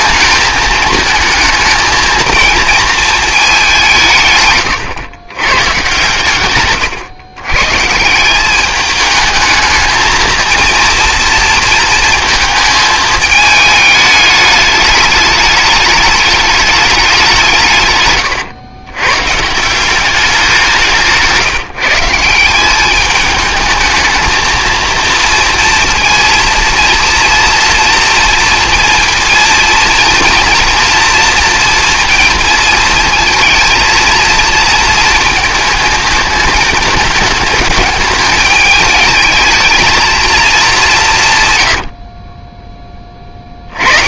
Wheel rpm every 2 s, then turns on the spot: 220, 220, 120, 120, 210, 230, 220, 210, 200, 130, 170, 210, 230, 230, 230, 230, 230, 230, 220, 220, 160, 10.
none